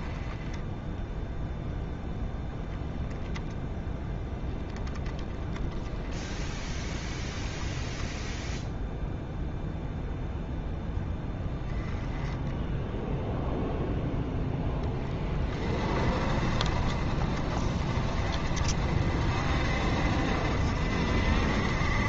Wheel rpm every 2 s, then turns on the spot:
10, 0, 30, 10, 0, 0, 10, 20, 40, 50, 60.
none